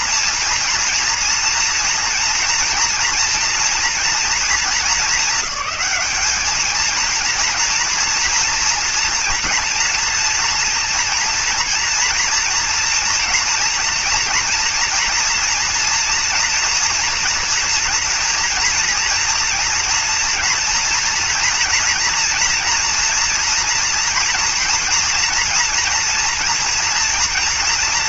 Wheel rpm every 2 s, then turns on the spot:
230, 230, 230, 220, 240, 230, 240, 230, 230, 230, 240, 230, 230, 230.
none